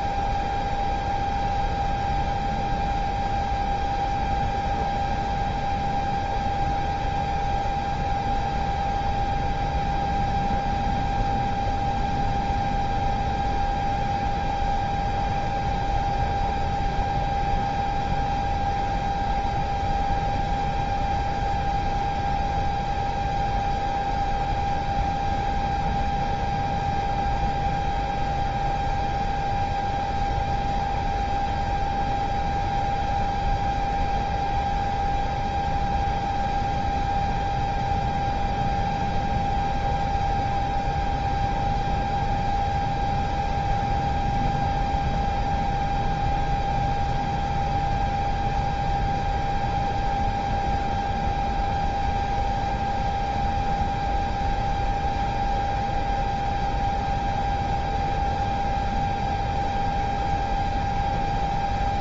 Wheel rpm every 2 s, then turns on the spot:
0, 0, 0, 0, 0, 0, 0, 0, 0, 0, 0, 0, 0, 0, 0, 0, 0, 0, 0, 0, 0, 0, 0, 0, 0, 0, 0, 0, 0, 0, 0.
none